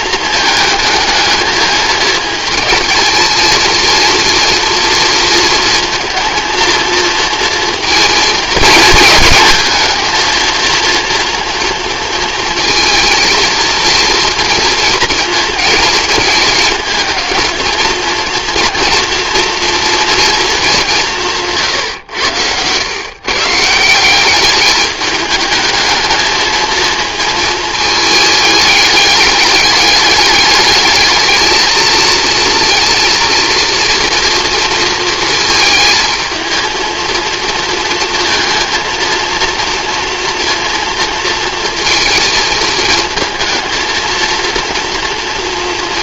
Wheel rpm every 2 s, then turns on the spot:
220, 220, 230, 230, 230, 230, 220, 240, 210, 230, 220, 110, 200, 220, 210, 210, 230, 230, 220, 230, 240, 230, 230.
none